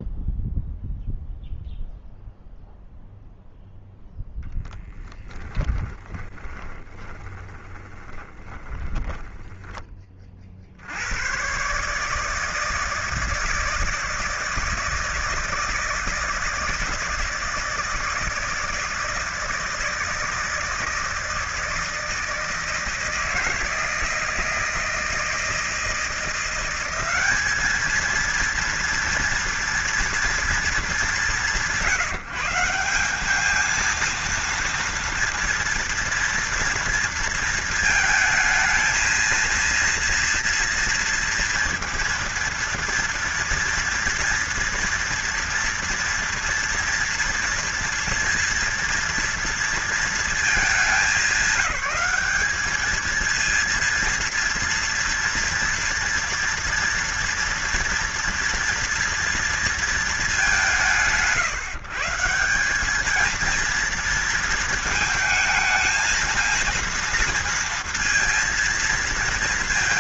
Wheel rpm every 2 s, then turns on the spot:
0, 0, 10, 20, 10, 80, 160, 160, 160, 160, 160, 160, 160, 190, 230, 190, 180, 230, 230, 230, 230, 230, 230, 230, 230, 200, 210, 230, 230, 230, 160, 210, 230, 230, 220.
4-10